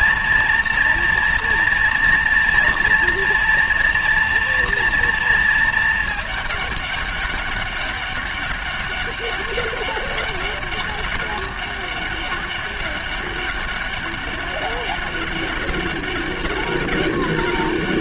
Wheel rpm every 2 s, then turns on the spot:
230, 230, 230, 210, 200, 200, 200, 200, 200.
none